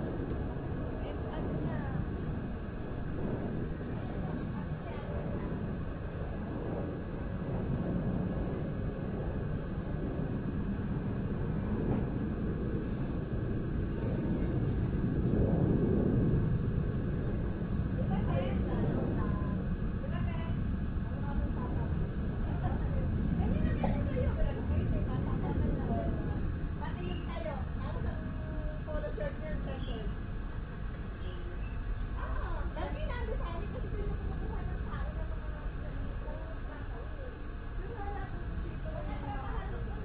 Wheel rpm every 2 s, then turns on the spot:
0, 0, 0, 0, 0, 0, 0, 0, 0, 0, 0, 0, 0, 0, 0, 0, 0, 0, 0, 0.
none